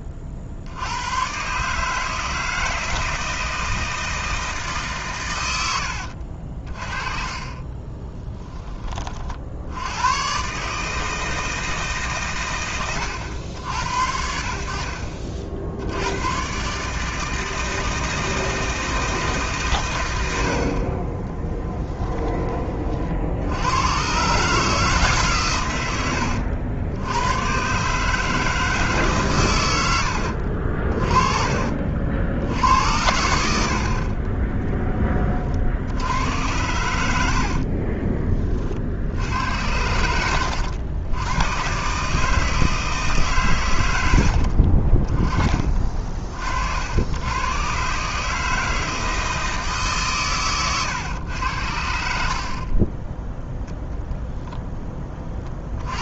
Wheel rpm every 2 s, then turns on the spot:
60, 160, 140, 40, 20, 150, 70, 70, 150, 160, 40, 40, 160, 90, 150, 40, 60, 10, 90, 60, 90, 160, 30, 80, 160, 120, 0, 10.
none